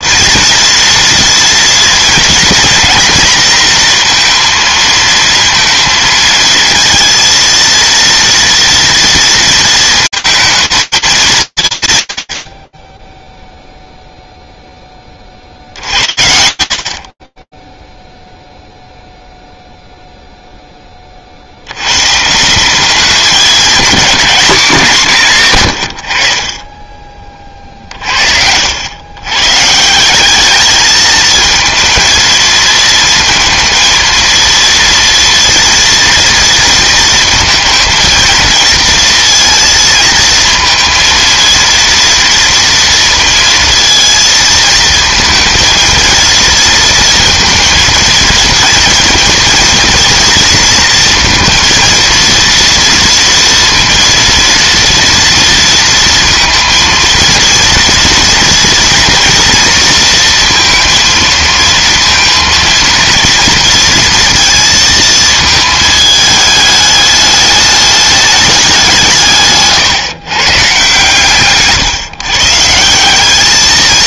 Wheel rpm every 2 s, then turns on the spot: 230, 230, 230, 230, 230, 210, 30, 10, 50, 0, 40, 200, 180, 30, 110, 220, 230, 230, 230, 230, 230, 230, 230, 230, 230, 230, 230, 230, 230, 230, 220, 230, 220, 210, 160, 140, 190.
none